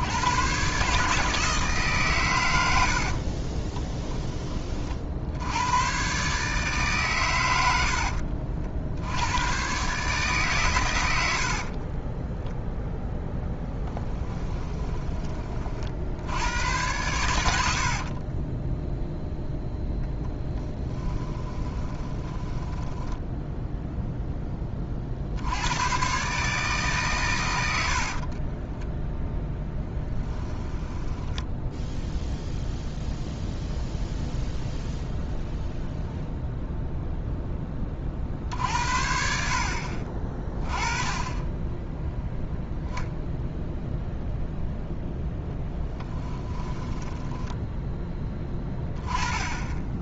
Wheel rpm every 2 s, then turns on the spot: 130, 70, 40, 140, 70, 110, 0, 10, 100, 20, 10, 10, 20, 140, 10, 10, 0, 0, 0, 60, 20, 0, 0, 10, 10.
2-4 14-16 18-24 28-32 46-48